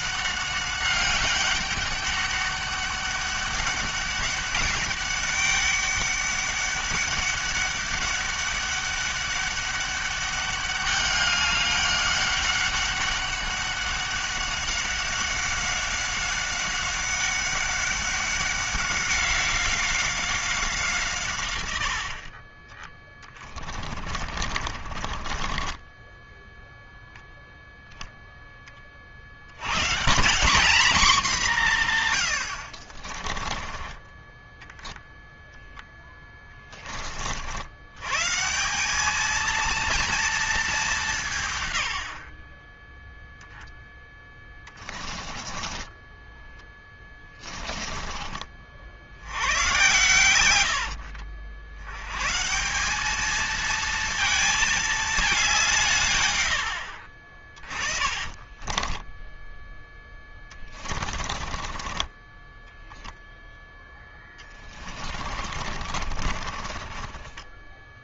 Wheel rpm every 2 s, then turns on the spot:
200, 200, 200, 200, 200, 200, 190, 190, 190, 190, 160, 30, 50, 0, 30, 190, 50, 10, 30, 190, 190, 20, 20, 10, 80, 70, 190, 220, 60, 20, 30, 10, 30, 40.
22-26 32-36 44-48 58-68